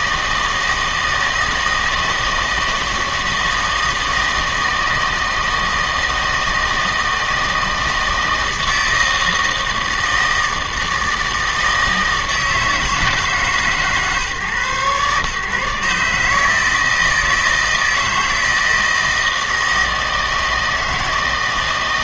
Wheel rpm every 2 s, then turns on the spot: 160, 160, 160, 160, 160, 160, 160, 130, 160, 160, 160.
none